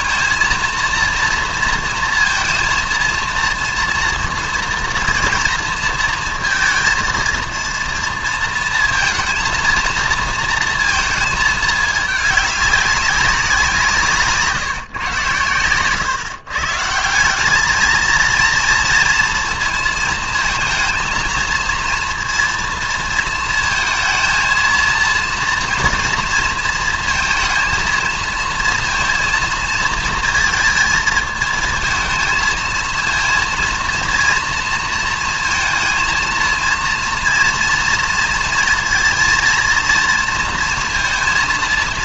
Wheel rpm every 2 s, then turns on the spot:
230, 230, 230, 230, 230, 230, 210, 150, 150, 230, 230, 230, 230, 230, 230, 220, 220, 230, 230, 230, 230.
none